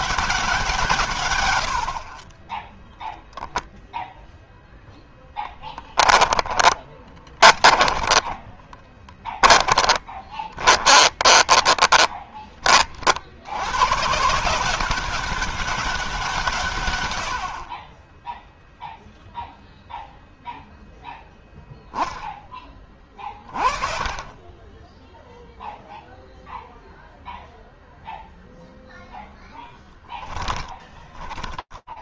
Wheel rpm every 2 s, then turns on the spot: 120, 0, 10, 20, 20, 20, 60, 200, 110, 0, 0, 30, 10, 0, 0, 20.
6-12 30-32